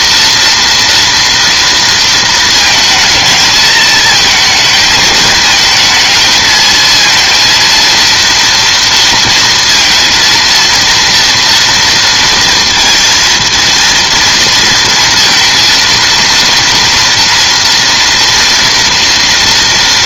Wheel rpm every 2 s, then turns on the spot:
230, 230, 220, 220, 230, 230, 230, 230, 230, 230.
none